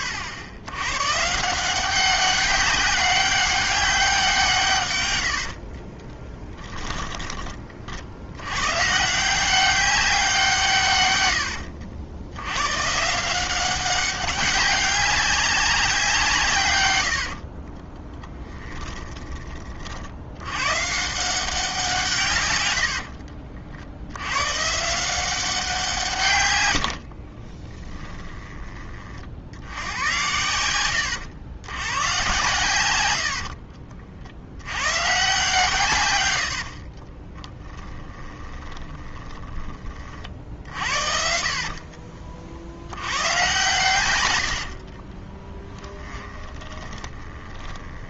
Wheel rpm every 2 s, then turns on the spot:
100, 200, 120, 10, 130, 140, 130, 200, 110, 10, 130, 90, 160, 80, 40, 100, 110, 110, 40, 10, 60, 80, 60, 20.
6-8 16-20 22-24 26-28 36-42 44-48